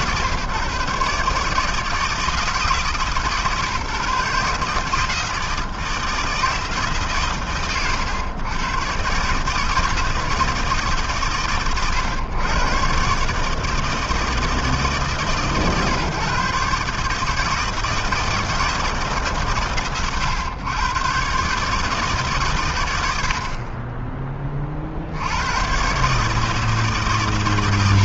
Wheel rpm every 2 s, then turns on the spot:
150, 130, 160, 110, 150, 110, 150, 140, 160, 120, 140, 40, 80, 130.
none